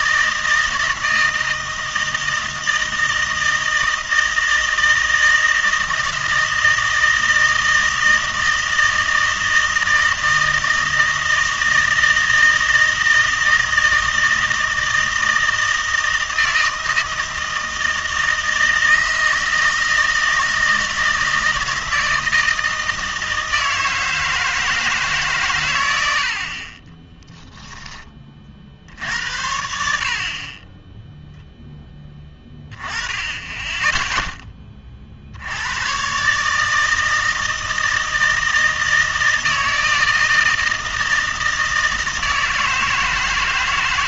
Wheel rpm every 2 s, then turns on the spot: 160, 160, 160, 160, 160, 160, 160, 160, 160, 160, 160, 160, 130, 10, 70, 0, 10, 70, 160, 160, 160, 160.
26-28